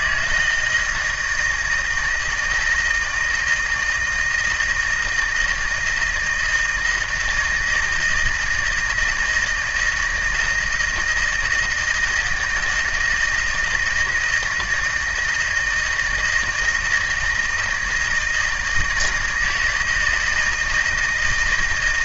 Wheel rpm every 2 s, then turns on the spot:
160, 160, 160, 160, 160, 170, 160, 160, 160, 160, 160.
none